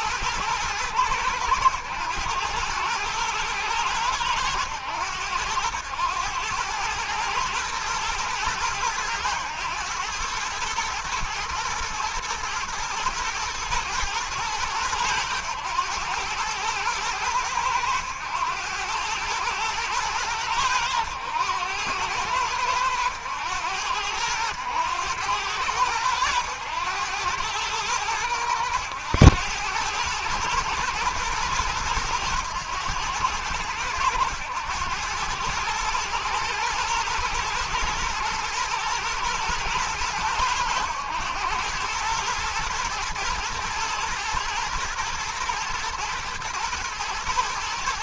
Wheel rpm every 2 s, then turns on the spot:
110, 110, 100, 110, 110, 110, 110, 100, 100, 100, 100, 90, 100, 100, 100, 120, 100, 100, 120, 110, 100, 120, 110, 110.
none